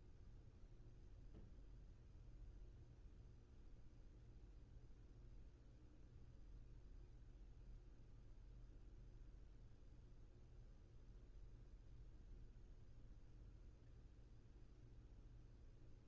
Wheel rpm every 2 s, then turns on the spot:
0, 0, 0, 0, 0, 0, 0, 0.
none